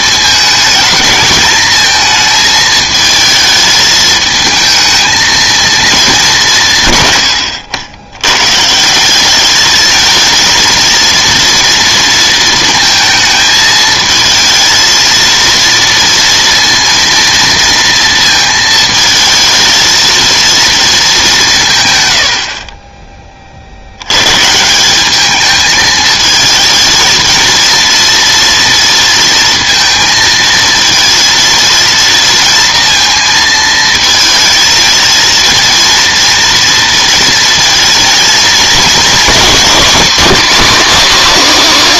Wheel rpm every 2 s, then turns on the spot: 220, 220, 230, 110, 200, 230, 220, 230, 230, 220, 200, 20, 210, 230, 230, 230, 220, 220, 230, 240, 270.
none